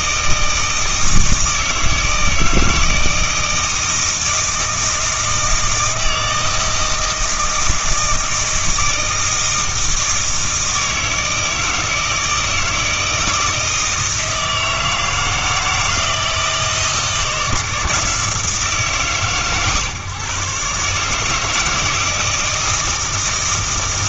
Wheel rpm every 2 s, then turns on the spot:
160, 160, 160, 160, 160, 160, 160, 160, 160, 150, 130, 160.
none